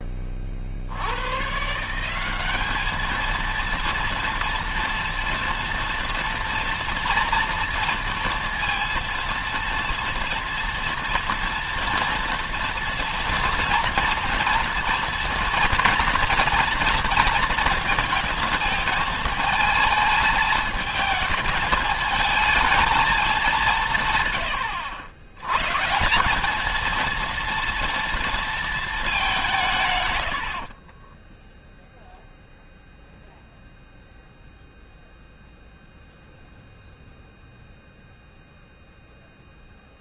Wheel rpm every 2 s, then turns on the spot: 40, 200, 230, 230, 230, 230, 230, 240, 230, 220, 220, 220, 110, 210, 230, 60, 0, 0, 0, 0.
30-32